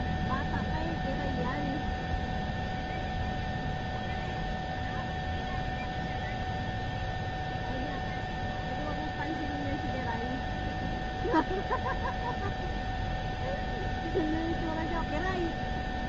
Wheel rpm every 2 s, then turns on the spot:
0, 0, 0, 0, 0, 0, 0, 0.
none